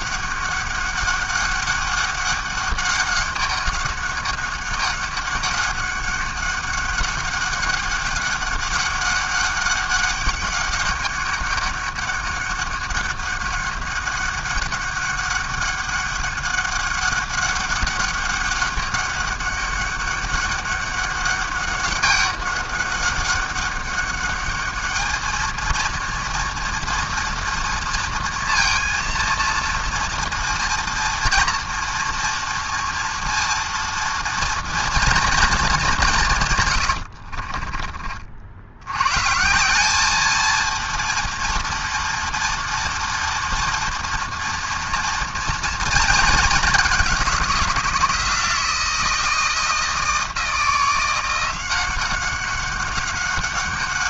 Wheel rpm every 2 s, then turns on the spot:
200, 200, 200, 200, 200, 200, 200, 200, 200, 200, 200, 200, 210, 230, 230, 230, 230, 230, 110, 90, 230, 240, 230, 210, 170, 170, 190.
36-38